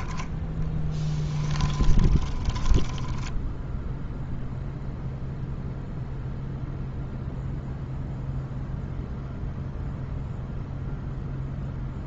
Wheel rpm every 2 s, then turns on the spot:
10, 10, 0, 0, 0, 0.
0-4